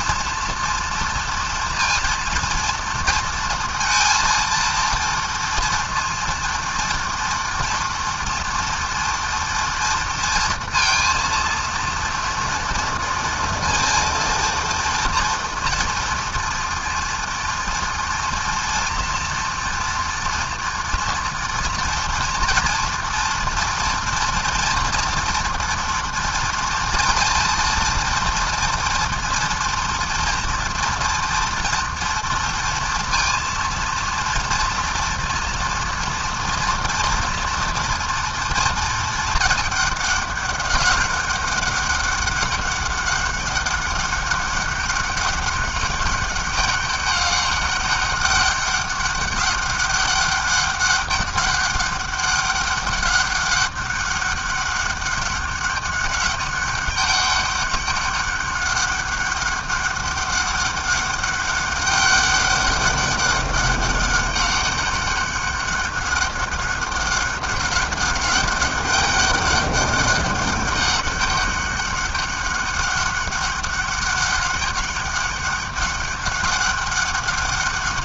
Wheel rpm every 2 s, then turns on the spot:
230, 230, 230, 230, 230, 230, 230, 230, 230, 230, 230, 230, 230, 230, 230, 230, 230, 230, 230, 230, 200, 200, 200, 200, 200, 200, 200, 200, 200, 200, 200, 200, 200, 200, 200, 200, 200, 200, 200.
none